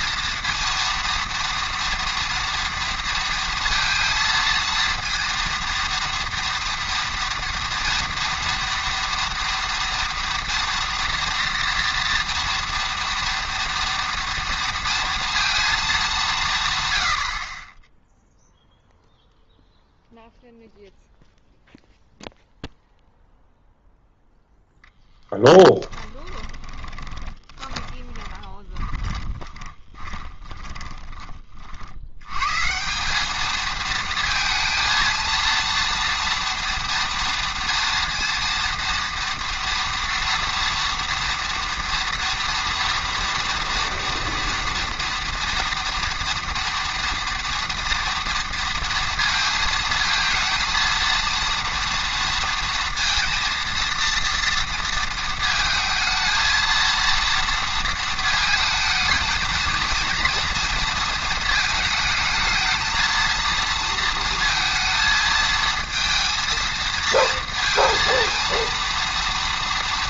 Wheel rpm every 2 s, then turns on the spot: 230, 230, 230, 230, 230, 230, 230, 230, 140, 0, 0, 0, 0, 20, 20, 20, 150, 230, 230, 230, 230, 230, 230, 230, 230, 230, 230, 230, 230, 220, 230, 220, 230, 230, 230.
26-32